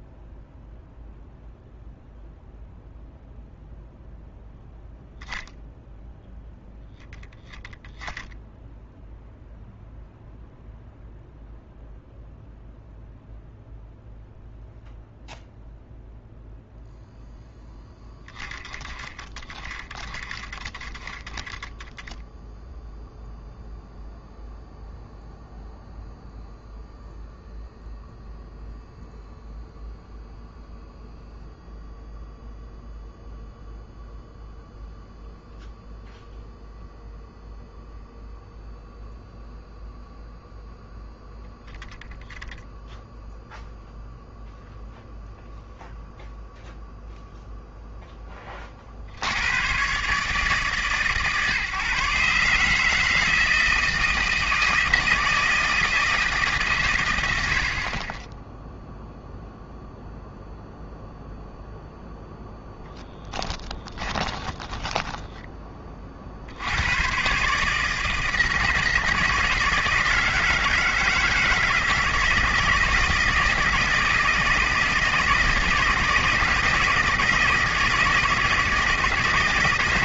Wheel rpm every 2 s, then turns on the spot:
0, 0, 0, 0, 0, 0, 0, 0, 0, 10, 20, 0, 0, 0, 0, 0, 0, 0, 0, 0, 0, 0, 0, 0, 30, 150, 150, 160, 140, 0, 0, 0, 10, 80, 160, 160, 160, 160, 170, 160.
64-66